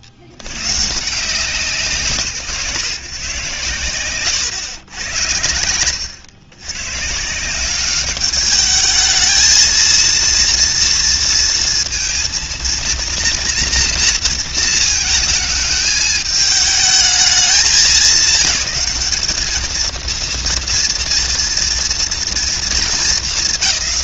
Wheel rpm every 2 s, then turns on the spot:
60, 140, 110, 110, 210, 230, 230, 230, 220, 210, 230, 230.
none